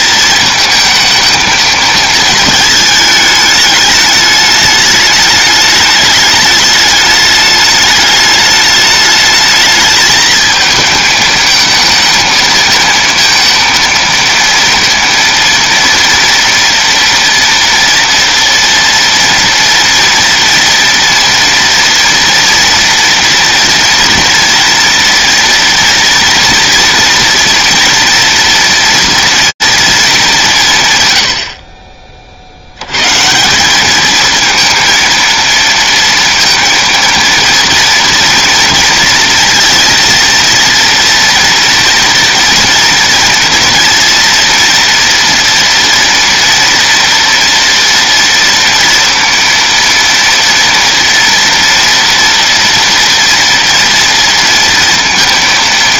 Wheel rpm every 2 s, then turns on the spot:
220, 220, 210, 210, 210, 220, 230, 230, 230, 230, 230, 230, 230, 230, 230, 130, 90, 230, 230, 230, 230, 230, 230, 230, 230, 230, 230, 230.
none